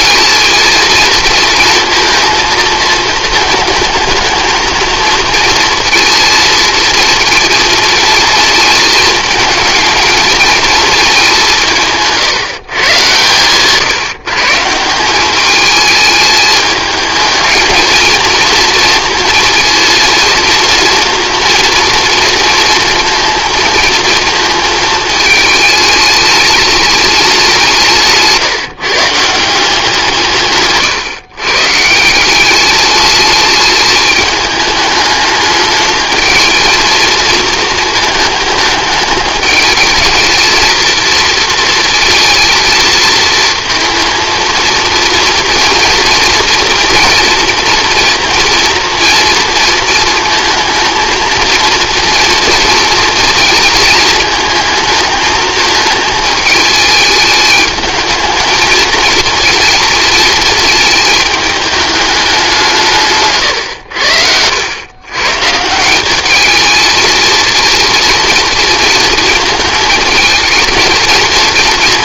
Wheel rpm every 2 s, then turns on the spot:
220, 220, 230, 230, 220, 220, 140, 170, 210, 230, 230, 230, 220, 210, 160, 140, 210, 210, 230, 210, 230, 220, 230, 240, 230, 220, 230, 220, 210, 220, 220, 170, 110, 220, 230, 230.
none